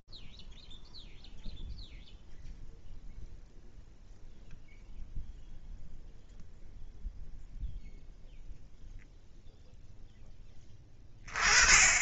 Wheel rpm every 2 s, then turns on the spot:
0, 0, 0, 0, 10, 10.
none